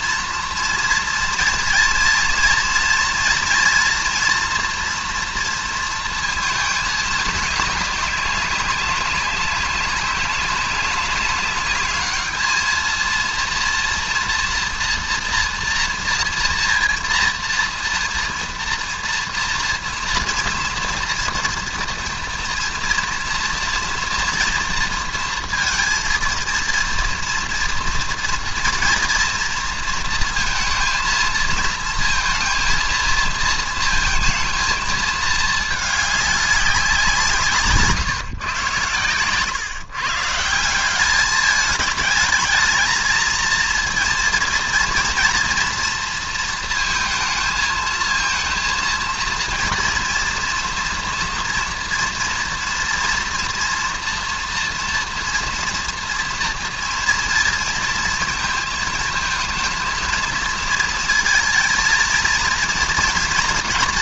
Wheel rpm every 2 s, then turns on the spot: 230, 230, 240, 220, 190, 190, 220, 240, 240, 230, 240, 240, 230, 230, 230, 220, 230, 220, 190, 120, 170, 220, 230, 230, 230, 230, 230, 230, 230, 220, 220, 230.
none